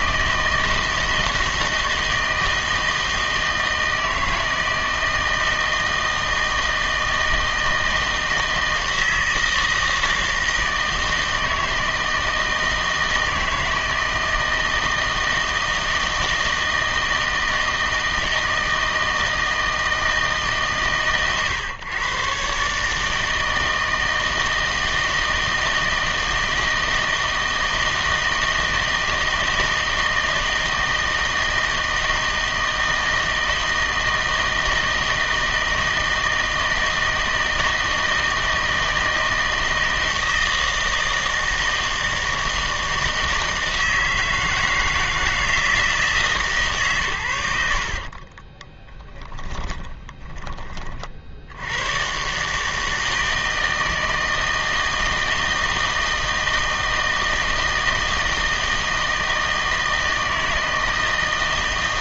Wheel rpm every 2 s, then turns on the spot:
160, 160, 160, 160, 160, 160, 160, 160, 160, 160, 140, 140, 160, 160, 160, 160, 160, 160, 160, 160, 160, 160, 160, 150, 20, 30, 150, 160, 160, 160, 160.
48-50